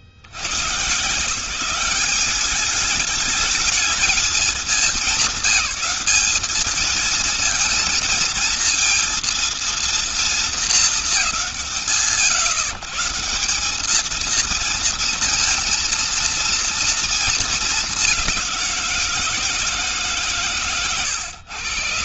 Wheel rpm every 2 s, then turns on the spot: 80, 190, 200, 210, 230, 230, 120, 220, 230, 190, 140.
none